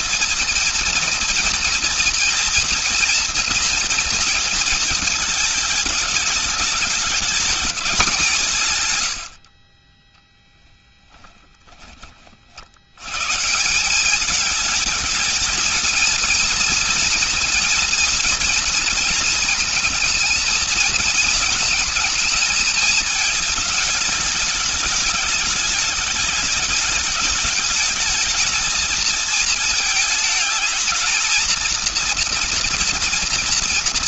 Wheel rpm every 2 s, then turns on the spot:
230, 240, 230, 210, 140, 10, 80, 220, 230, 230, 230, 220, 210, 210, 220, 220, 230.
8-12